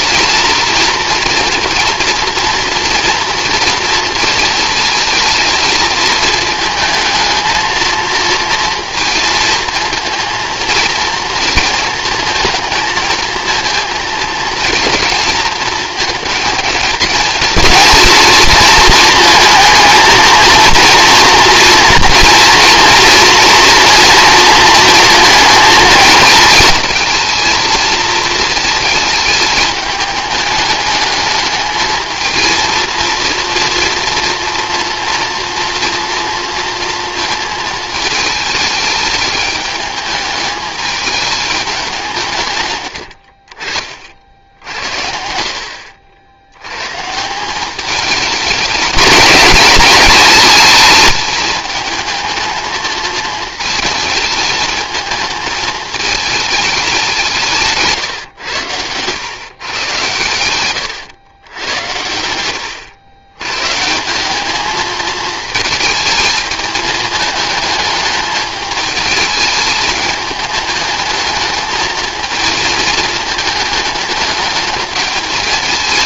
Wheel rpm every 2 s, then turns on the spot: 230, 240, 230, 220, 230, 230, 220, 230, 230, 230, 230, 240, 230, 220, 220, 210, 230, 230, 230, 210, 210, 90, 80, 130, 210, 210, 220, 220, 190, 110, 120, 100, 220, 220, 210, 210, 220, 210.
42-44 58-60